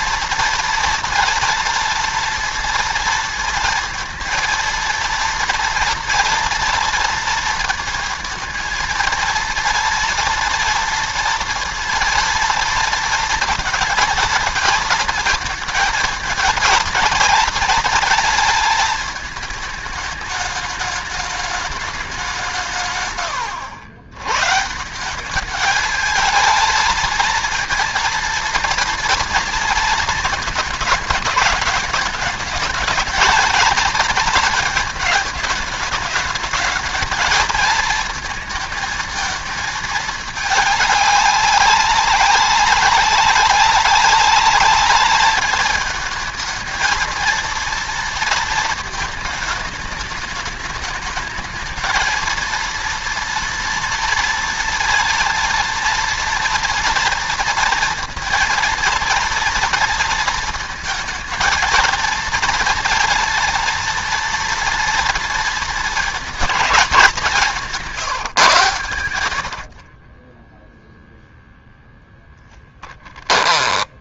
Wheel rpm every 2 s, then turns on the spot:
230, 230, 230, 230, 230, 230, 230, 220, 230, 230, 220, 150, 160, 220, 230, 220, 220, 230, 210, 220, 210, 190, 210, 220, 220, 210, 230, 230, 230, 230, 220, 230, 230, 210, 120, 0, 10.
none